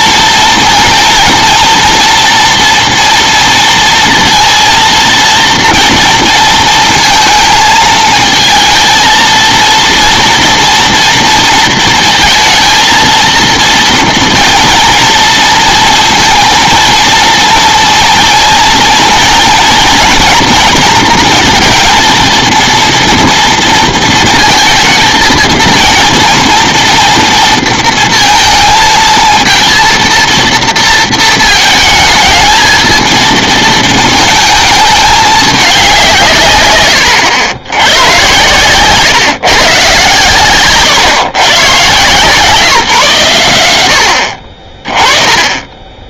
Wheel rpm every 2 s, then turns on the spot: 240, 230, 230, 230, 220, 240, 230, 230, 230, 230, 230, 230, 230, 230, 230, 230, 220, 220, 130, 110, 130, 150, 50.
40-42